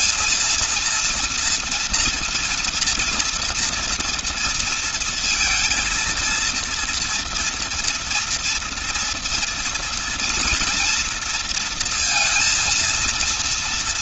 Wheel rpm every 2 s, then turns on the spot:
230, 230, 230, 230, 230, 230, 230.
none